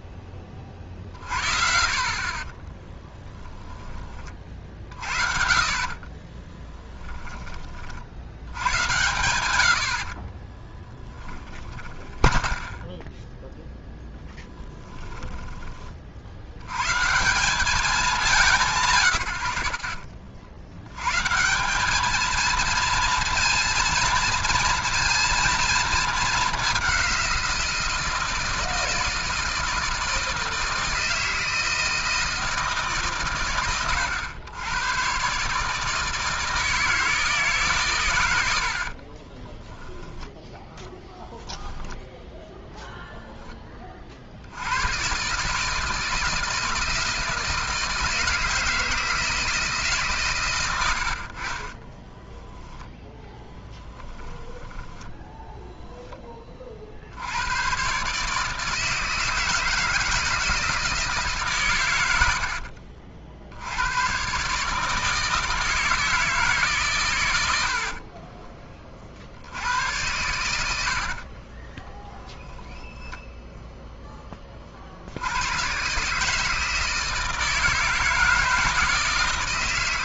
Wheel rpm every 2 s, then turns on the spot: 30, 30, 40, 20, 100, 30, 10, 10, 80, 170, 100, 230, 230, 200, 160, 160, 150, 110, 160, 80, 10, 0, 80, 160, 160, 110, 0, 10, 30, 160, 160, 70, 140, 150, 30, 90, 0, 30, 150, 160.
2-4 6-8 10-16 54-56 62-64 68-72